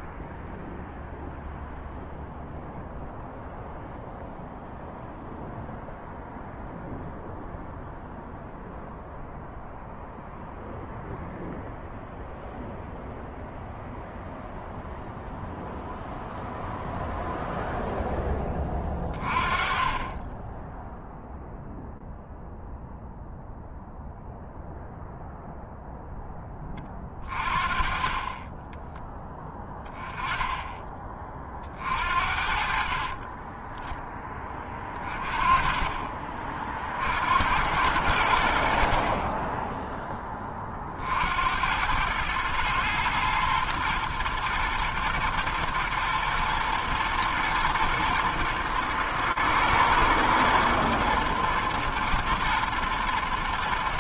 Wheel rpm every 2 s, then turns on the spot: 0, 0, 0, 0, 0, 0, 0, 0, 0, 10, 20, 0, 0, 10, 20, 20, 60, 20, 30, 80, 20, 110, 110, 110, 110, 110, 110.
none